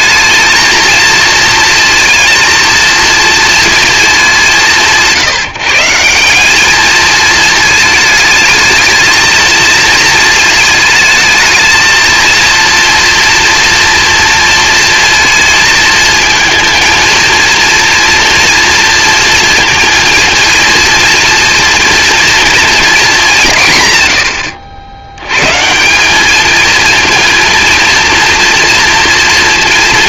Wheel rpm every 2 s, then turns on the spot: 220, 230, 160, 200, 220, 220, 230, 230, 220, 230, 230, 230, 80, 220, 240.
none